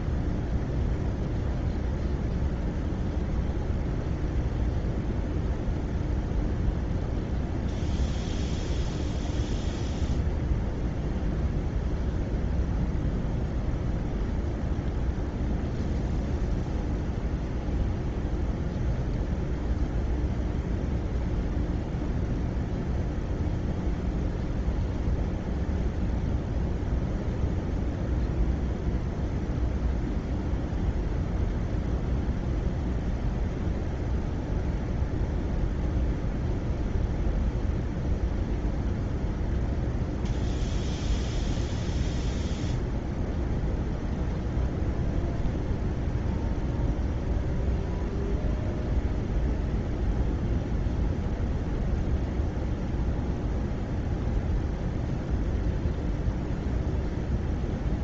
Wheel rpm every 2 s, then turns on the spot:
0, 0, 0, 0, 0, 0, 0, 0, 0, 0, 0, 0, 0, 0, 0, 0, 0, 0, 0, 0, 0, 0, 0, 0, 0, 0, 0, 0, 0.
none